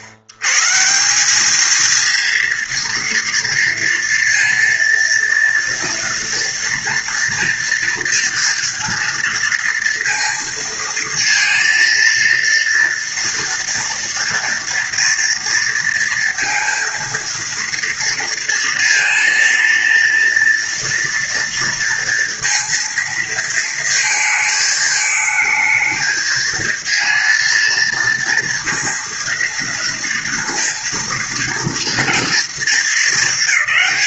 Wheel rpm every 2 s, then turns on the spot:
100, 230, 230, 230, 230, 230, 230, 240, 230, 230, 230, 230, 220, 230, 230, 230, 230.
none